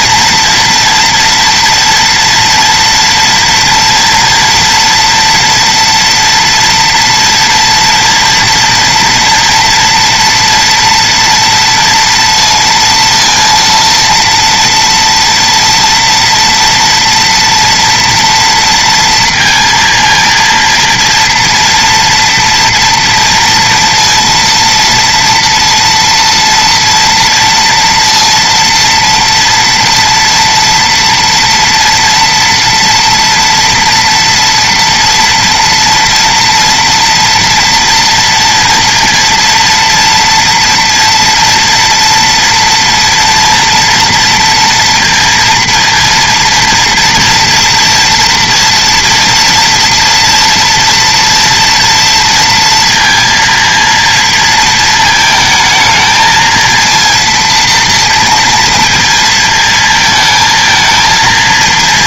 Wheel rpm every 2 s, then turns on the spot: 230, 240, 240, 230, 230, 230, 230, 230, 230, 230, 230, 240, 230, 230, 230, 240, 230, 230, 230, 230, 230, 230, 230, 230, 230, 230, 230, 220, 230, 230, 220.
none